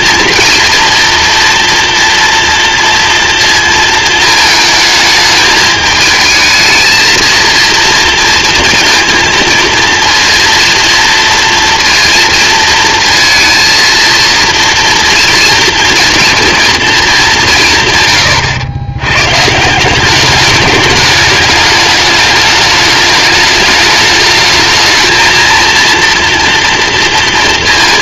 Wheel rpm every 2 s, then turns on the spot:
230, 230, 220, 220, 230, 230, 230, 230, 230, 100, 210, 210, 220, 230.
none